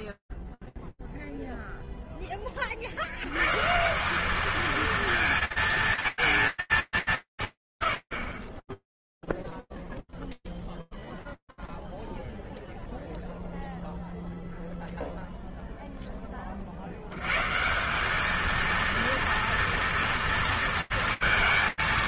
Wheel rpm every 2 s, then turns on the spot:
50, 10, 190, 220, 30, 0, 0, 0, 80, 230, 220.
none